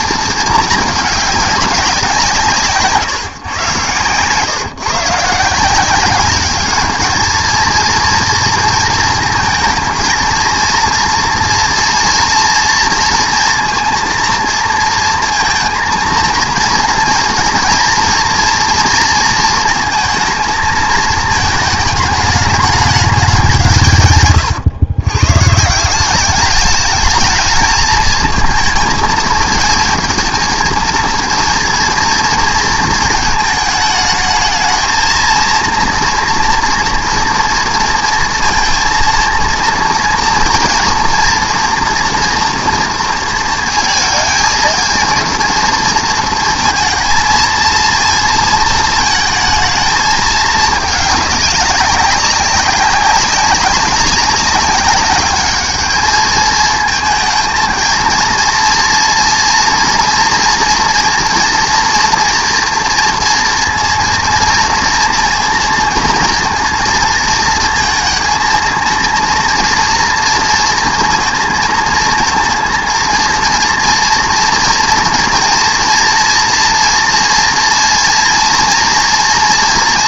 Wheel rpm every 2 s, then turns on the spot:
220, 160, 140, 200, 230, 230, 230, 230, 230, 230, 220, 210, 120, 210, 220, 230, 230, 220, 230, 230, 240, 240, 230, 230, 230, 210, 200, 200, 220, 230, 240, 230, 230, 230, 220, 230, 230, 230, 230, 230.
none